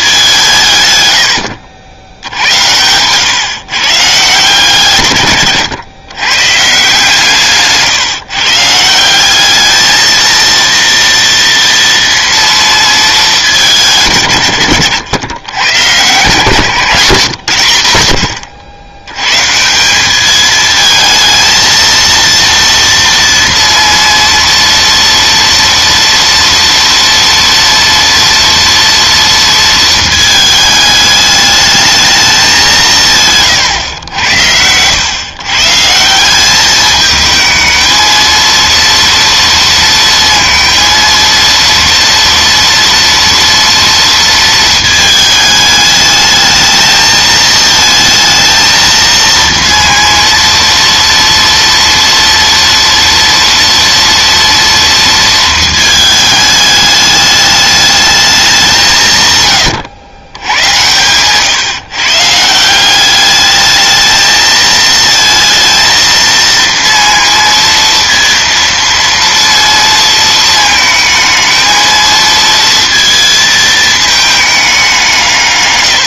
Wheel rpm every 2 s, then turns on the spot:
150, 90, 140, 150, 160, 230, 230, 110, 150, 80, 220, 230, 230, 230, 230, 210, 180, 90, 210, 230, 230, 230, 230, 220, 230, 230, 230, 230, 210, 170, 110, 170, 220, 230, 230, 220, 230, 200.
16-18